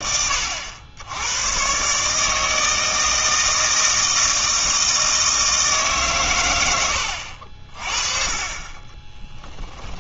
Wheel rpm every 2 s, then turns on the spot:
90, 160, 160, 90, 20.
8-10